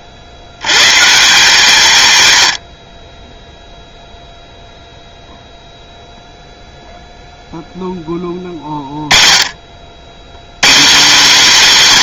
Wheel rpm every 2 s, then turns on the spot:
90, 80, 0, 0, 40, 180.
none